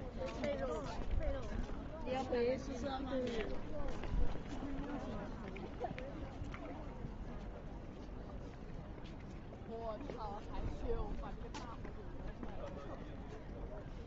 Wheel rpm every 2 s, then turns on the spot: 0, 0, 0, 0, 0, 0, 0.
none